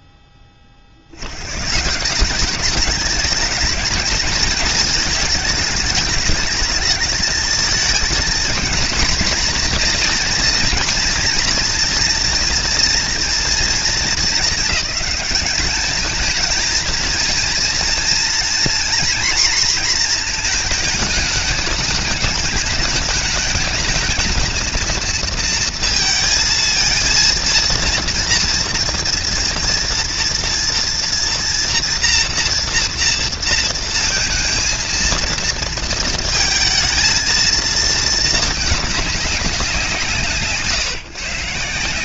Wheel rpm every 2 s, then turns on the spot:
60, 220, 210, 220, 240, 240, 230, 210, 230, 240, 210, 210, 230, 230, 230, 230, 230, 230, 220, 210, 130.
none